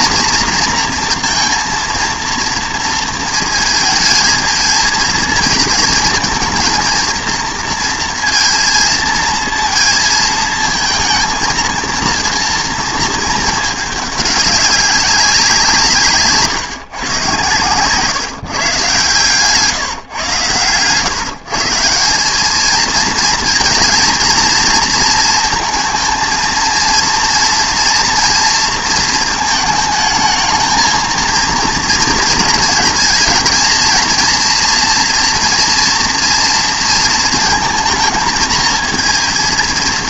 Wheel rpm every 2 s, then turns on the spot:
240, 230, 220, 230, 230, 230, 230, 200, 140, 140, 120, 220, 230, 230, 230, 220, 220, 230, 230, 230.
none